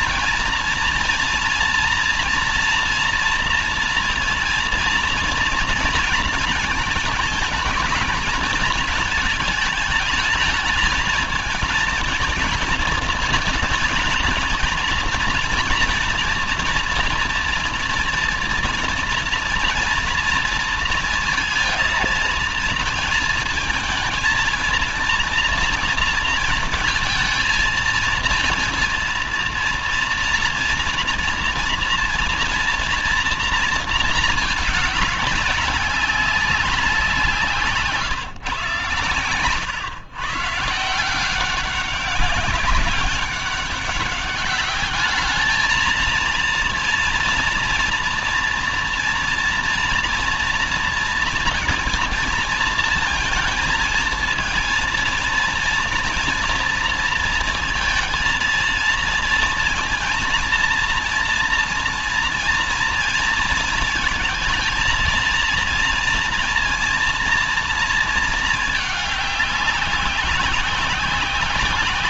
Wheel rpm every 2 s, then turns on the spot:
230, 230, 230, 220, 220, 210, 220, 230, 230, 230, 230, 230, 230, 230, 230, 230, 240, 210, 180, 140, 140, 200, 200, 230, 230, 230, 230, 230, 230, 230, 230, 230, 220, 230, 220, 190.
none